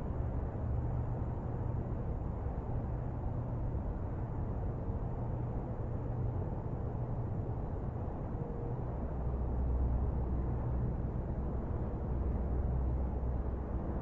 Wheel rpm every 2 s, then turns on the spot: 0, 0, 0, 0, 0, 0, 0.
none